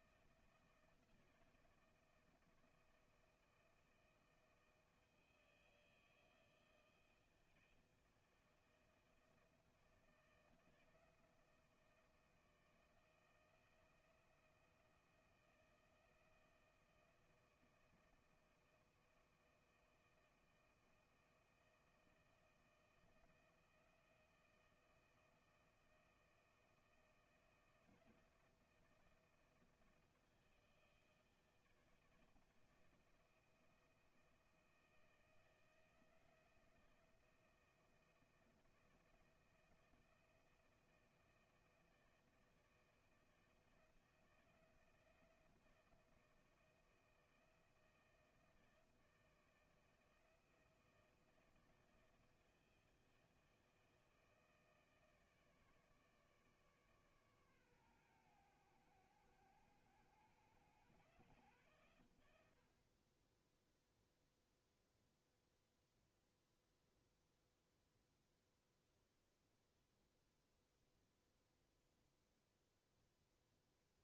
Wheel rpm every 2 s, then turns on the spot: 160, 160, 160, 160, 160, 170, 160, 170, 160, 160, 160, 160, 160, 160, 160, 160, 160, 160, 160, 160, 170, 160, 160, 160, 160, 160, 160, 160, 150, 100, 110, 90, 0, 0, 0, 0, 0.
none